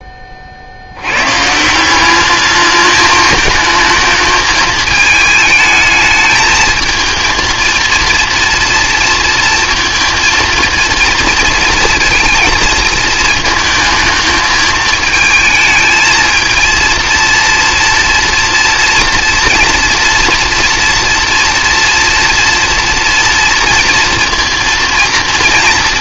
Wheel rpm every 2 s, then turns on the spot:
60, 210, 220, 220, 230, 230, 230, 220, 230, 230, 230, 240, 230.
none